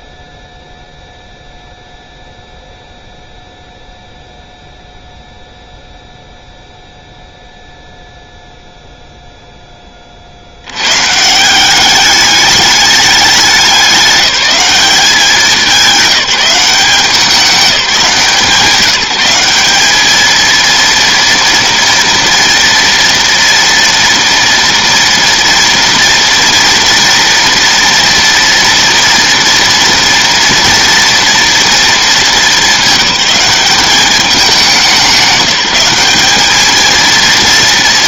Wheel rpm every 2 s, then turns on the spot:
0, 0, 0, 0, 0, 120, 200, 200, 190, 180, 230, 230, 230, 230, 230, 230, 210, 190, 220.
none